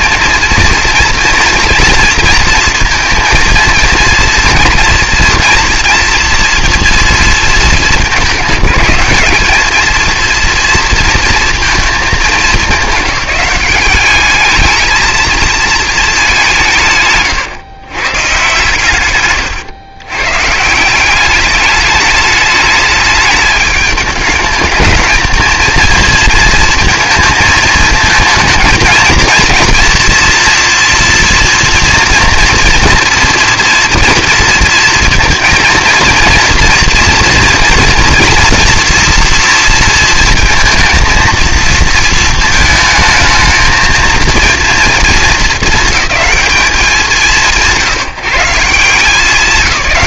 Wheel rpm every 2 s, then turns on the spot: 230, 230, 230, 220, 210, 230, 200, 220, 140, 120, 190, 210, 220, 220, 230, 240, 240, 230, 230, 230, 230, 220, 220, 180, 170.
none